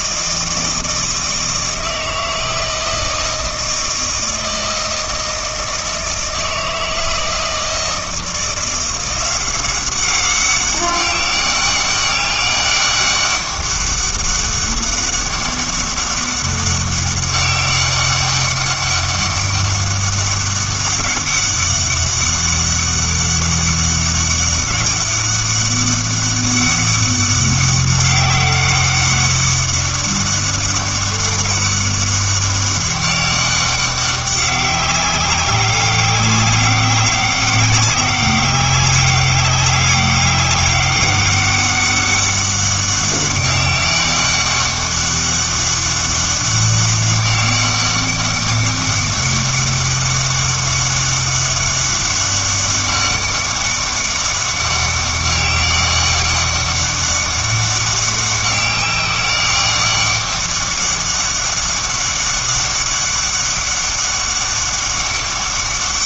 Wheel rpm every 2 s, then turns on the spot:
160, 160, 160, 160, 170, 200, 200, 200, 200, 200, 200, 200, 190, 200, 190, 200, 190, 190, 200, 200, 200, 200, 200, 200, 200, 200, 200, 200, 200, 200, 200, 200, 200.
none